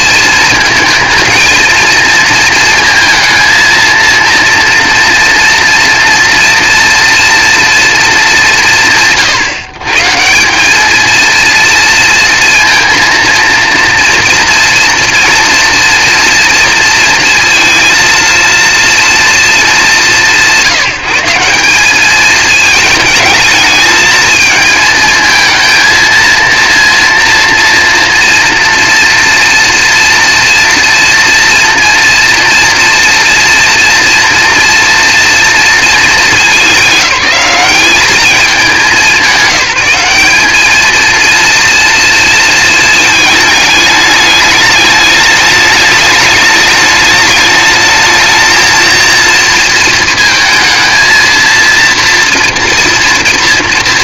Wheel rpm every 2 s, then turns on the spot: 220, 230, 230, 230, 190, 190, 230, 230, 230, 230, 170, 220, 220, 230, 230, 230, 230, 240, 210, 210, 210, 230, 210, 210, 220, 220, 230.
none